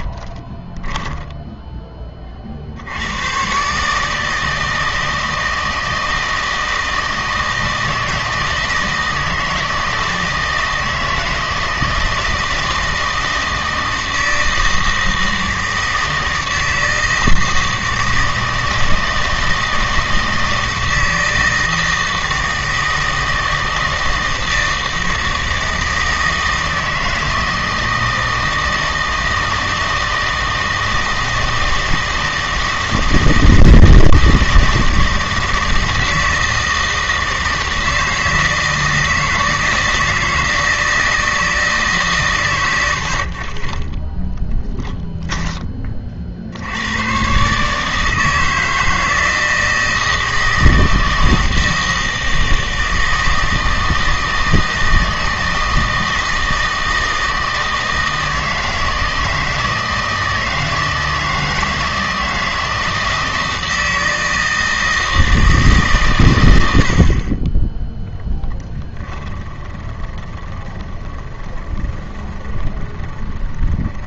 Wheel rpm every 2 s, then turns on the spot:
20, 60, 160, 160, 160, 160, 160, 160, 160, 160, 160, 160, 160, 160, 160, 160, 160, 160, 160, 160, 160, 110, 10, 70, 160, 160, 160, 160, 160, 160, 160, 160, 160, 80, 10, 20, 20.
0-2 44-46 68-74